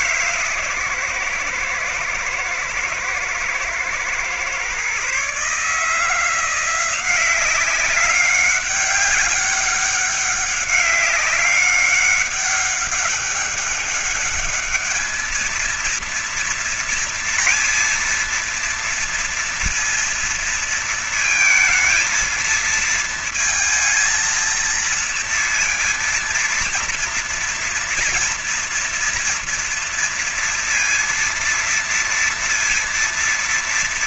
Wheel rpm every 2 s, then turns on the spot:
140, 110, 120, 160, 190, 200, 200, 210, 230, 230, 230, 220, 230, 230, 230, 230, 230.
none